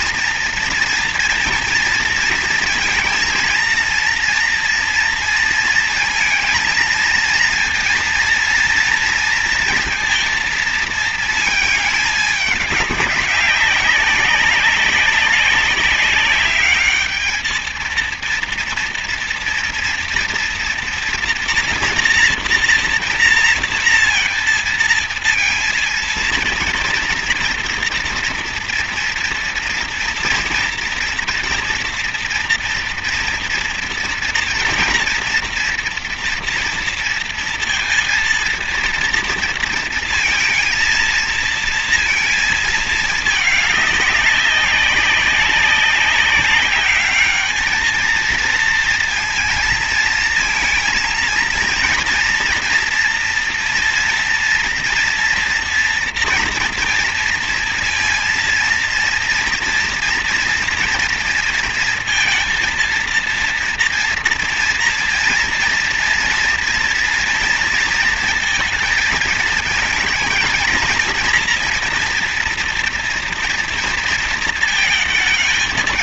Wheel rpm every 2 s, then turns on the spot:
230, 230, 230, 230, 230, 230, 210, 200, 200, 230, 230, 230, 230, 230, 230, 230, 230, 240, 240, 230, 230, 220, 190, 190, 230, 230, 230, 230, 230, 230, 230, 230, 230, 230, 230, 220, 230, 230.
none